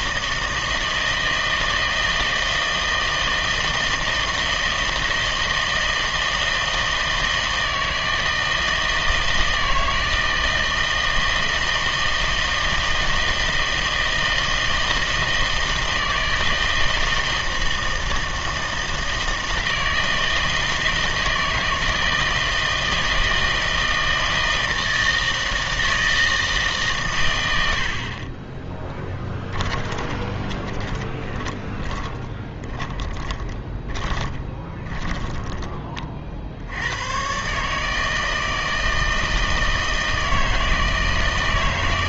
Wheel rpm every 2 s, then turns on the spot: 160, 160, 160, 160, 160, 160, 160, 160, 160, 160, 160, 160, 160, 150, 10, 20, 30, 20, 90, 160, 160.
28-36